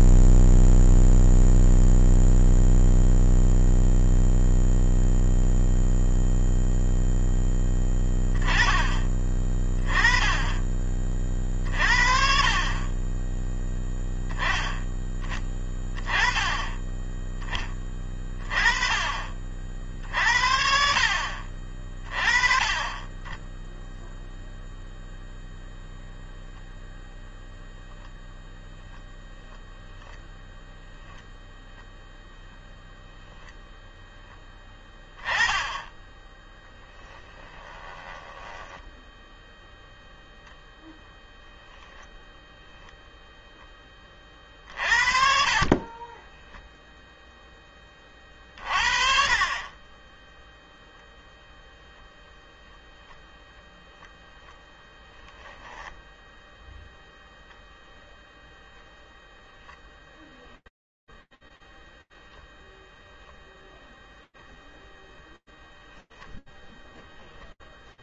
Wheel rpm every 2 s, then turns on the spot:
0, 0, 0, 0, 10, 10, 40, 10, 20, 30, 60, 20, 0, 0, 0, 0, 0, 10, 10, 10, 0, 0, 40, 10, 20, 10, 0, 0, 0, 0, 0, 0, 0, 0.
38-40 46-48